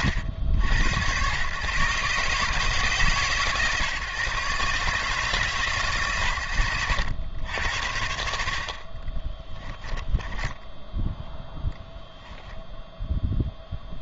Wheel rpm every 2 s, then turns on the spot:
90, 140, 140, 100, 70, 10, 0.
10-12